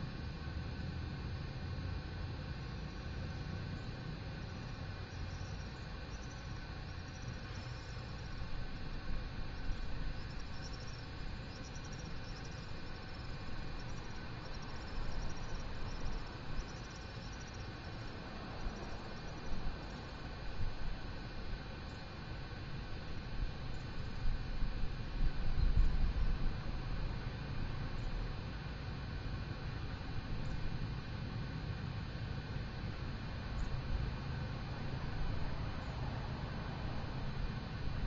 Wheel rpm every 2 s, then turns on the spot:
0, 0, 0, 0, 0, 0, 0, 0, 0, 0, 0, 0, 0, 0, 0, 0, 0, 0, 0.
none